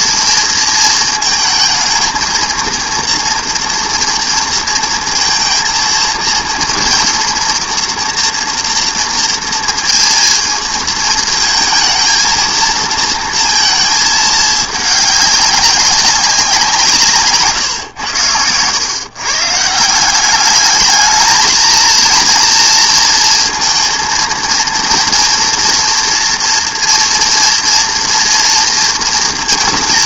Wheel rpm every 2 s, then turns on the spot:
230, 230, 230, 230, 230, 230, 230, 210, 170, 110, 210, 230, 230, 230, 230.
none